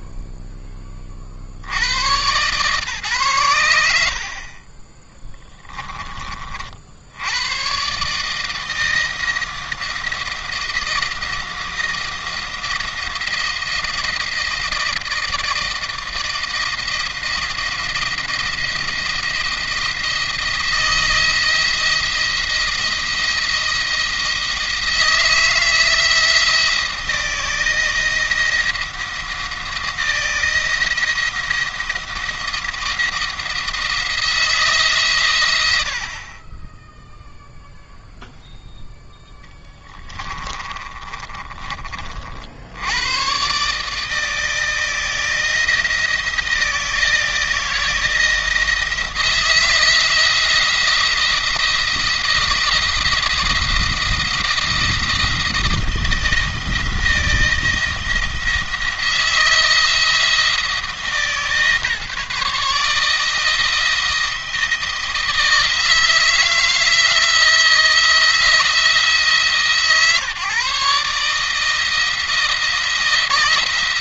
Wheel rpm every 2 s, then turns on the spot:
10, 130, 30, 60, 160, 170, 170, 160, 170, 170, 170, 170, 160, 160, 170, 170, 170, 150, 10, 0, 30, 80, 160, 170, 170, 170, 170, 170, 170, 160, 160, 150, 170, 160, 160, 150, 160.
40-42